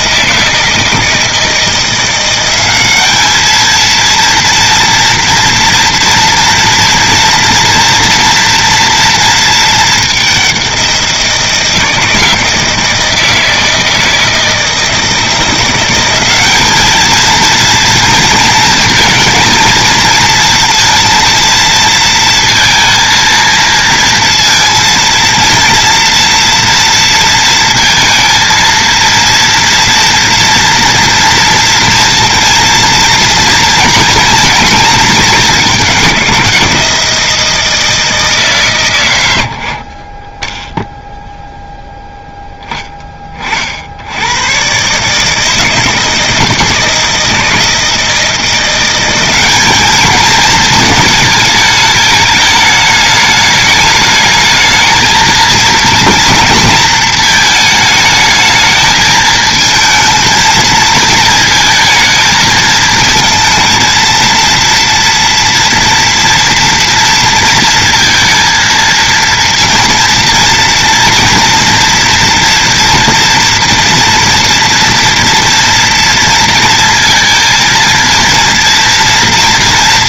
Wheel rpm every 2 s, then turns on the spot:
160, 190, 230, 240, 230, 190, 160, 160, 210, 230, 230, 230, 230, 230, 230, 230, 230, 230, 180, 150, 20, 20, 120, 160, 180, 220, 210, 220, 230, 220, 220, 220, 230, 230, 230, 230, 240, 230, 230, 230.
none